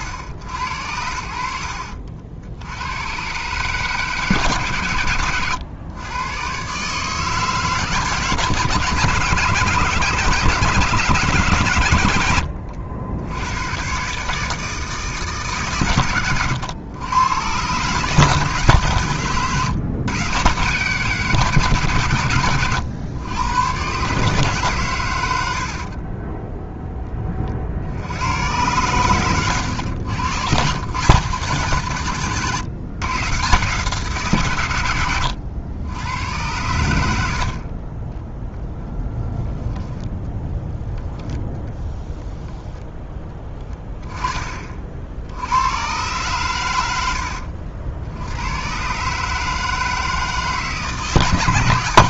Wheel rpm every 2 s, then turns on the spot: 100, 80, 140, 130, 140, 140, 90, 150, 100, 150, 140, 100, 140, 10, 110, 120, 140, 130, 90, 10, 10, 10, 30, 110, 100, 160.
26-28 40-42